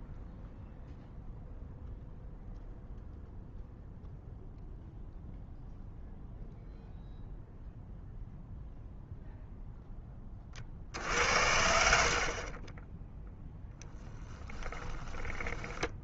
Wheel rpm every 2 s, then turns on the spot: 0, 0, 0, 0, 0, 40, 30, 10.
12-16